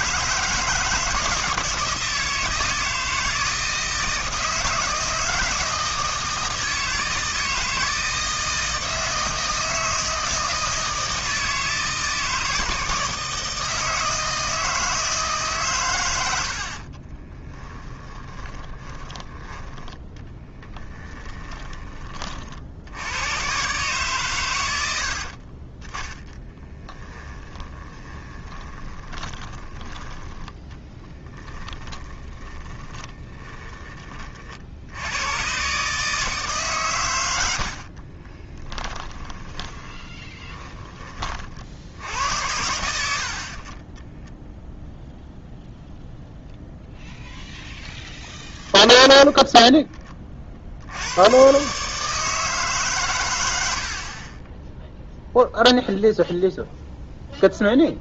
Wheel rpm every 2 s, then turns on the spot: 160, 160, 160, 160, 160, 160, 160, 160, 40, 20, 10, 80, 90, 20, 20, 10, 20, 80, 130, 20, 40, 90, 0, 0, 10, 80, 140, 0, 0.
16-22 26-34 38-42 48-50